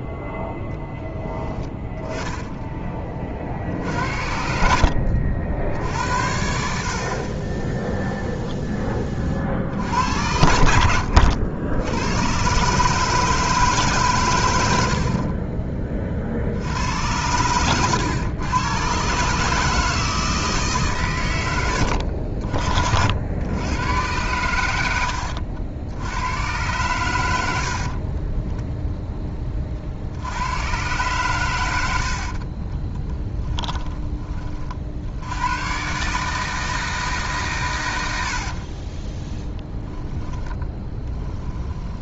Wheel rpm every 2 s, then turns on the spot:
0, 30, 70, 60, 20, 80, 140, 60, 80, 120, 140, 60, 90, 120, 10, 110, 20, 50, 160, 30, 10.
4-6 10-12 32-34 38-42